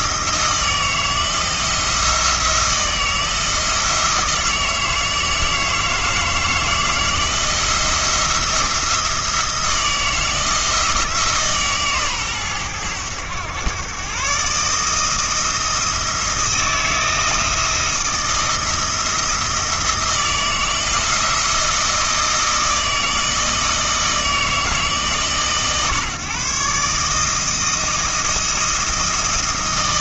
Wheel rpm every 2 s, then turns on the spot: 160, 160, 160, 160, 170, 160, 110, 160, 160, 170, 170, 160, 150, 150, 160.
none